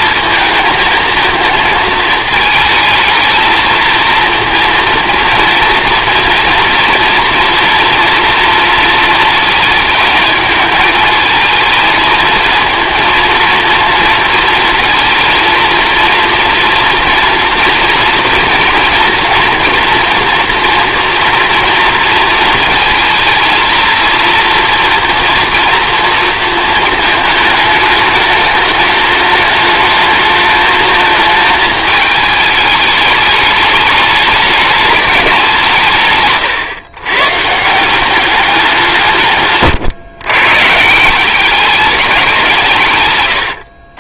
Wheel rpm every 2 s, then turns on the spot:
220, 220, 230, 230, 230, 220, 230, 230, 240, 240, 230, 220, 230, 220, 210, 220, 210, 210, 140, 190, 150, 170.
none